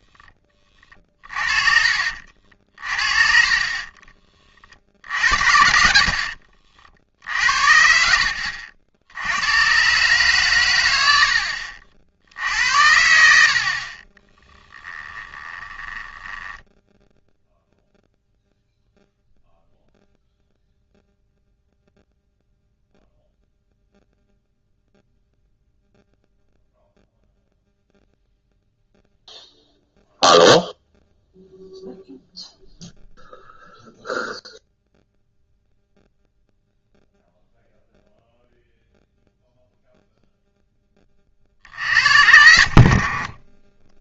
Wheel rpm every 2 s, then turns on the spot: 30, 50, 30, 60, 70, 110, 80, 10, 10, 0, 0, 0, 0, 0, 0, 0, 0, 0, 0, 0, 10, 60.
0-4 14-18 42-44